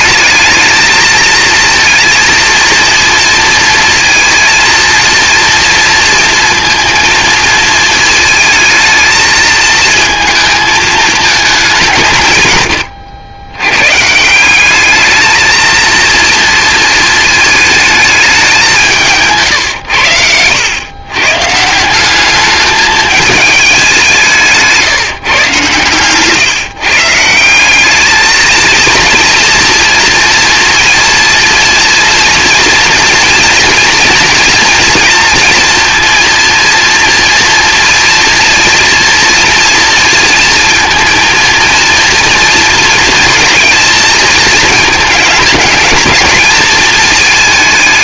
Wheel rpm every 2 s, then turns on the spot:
220, 230, 230, 230, 220, 220, 90, 220, 220, 160, 110, 210, 150, 160, 230, 240, 230, 230, 230, 230, 230, 220, 220, 220.
none